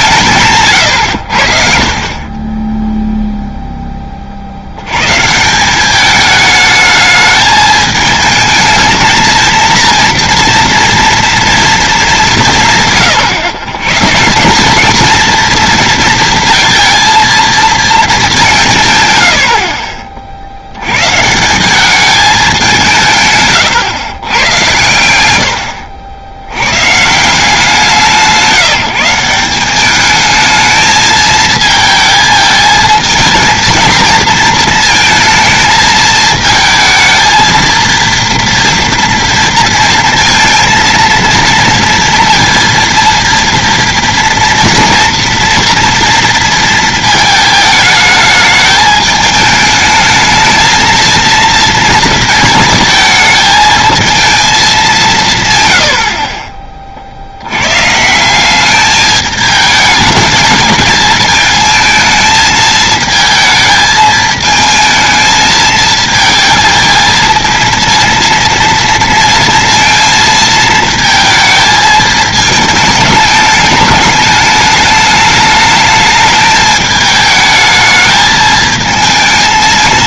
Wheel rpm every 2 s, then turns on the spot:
130, 10, 80, 210, 220, 230, 160, 210, 230, 160, 90, 170, 100, 110, 170, 220, 220, 230, 220, 230, 230, 230, 240, 230, 220, 230, 220, 210, 40, 200, 210, 220, 220, 220, 230, 220, 220, 210, 210, 220.
0-2